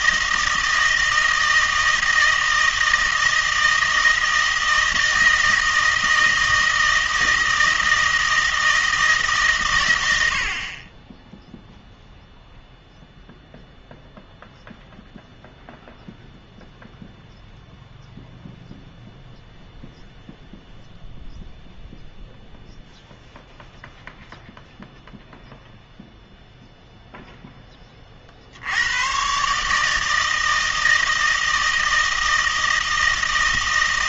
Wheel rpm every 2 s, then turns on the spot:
160, 160, 160, 160, 160, 50, 0, 0, 0, 0, 0, 0, 0, 0, 80, 160, 160.
none